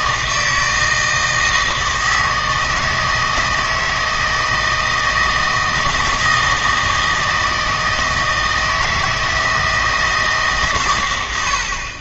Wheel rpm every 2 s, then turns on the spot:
160, 160, 160, 160, 160, 140.
none